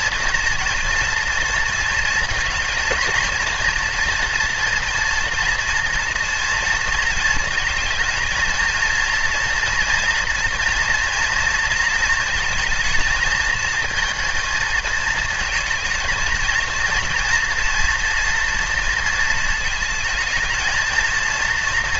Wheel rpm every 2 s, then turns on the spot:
230, 230, 230, 230, 230, 240, 230, 230, 230, 230, 230.
none